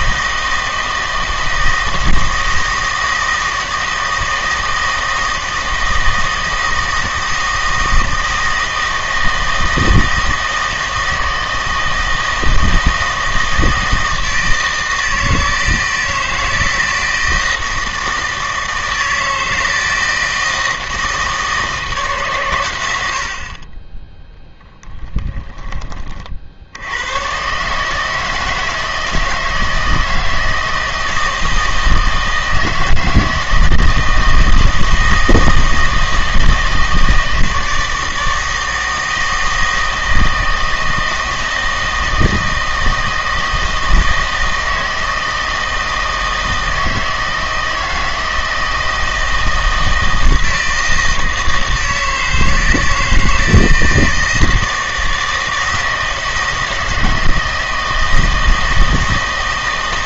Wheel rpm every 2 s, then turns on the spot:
160, 160, 160, 160, 160, 160, 160, 160, 160, 160, 160, 110, 10, 70, 160, 160, 160, 160, 160, 160, 160, 160, 160, 160, 160, 160, 160, 160, 160, 160.
24-26